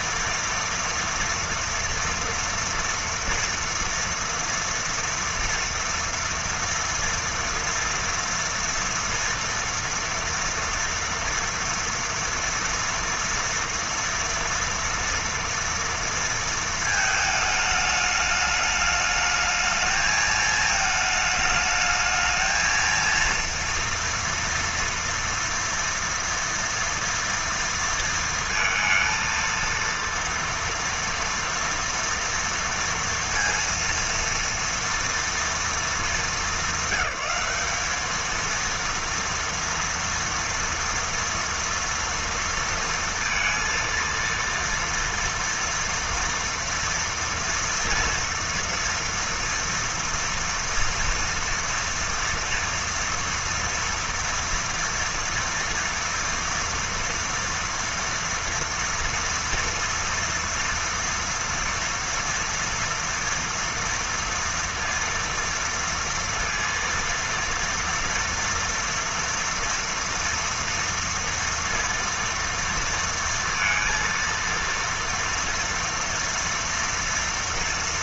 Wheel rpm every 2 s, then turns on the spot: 230, 240, 230, 230, 230, 230, 230, 230, 220, 210, 220, 230, 230, 230, 230, 230, 230, 230, 200, 230, 230, 230, 230, 230, 230, 230, 230, 230, 230, 230, 230, 230, 230, 230, 230, 240, 230, 230, 230.
none